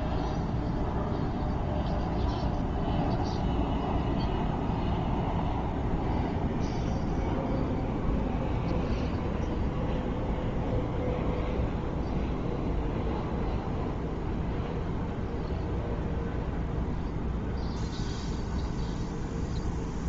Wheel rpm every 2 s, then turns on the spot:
0, 0, 0, 0, 0, 0, 0, 0, 0, 0.
none